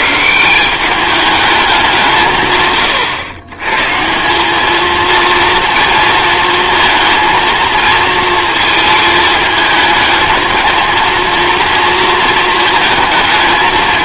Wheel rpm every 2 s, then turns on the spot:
180, 120, 210, 230, 230, 220, 220.
none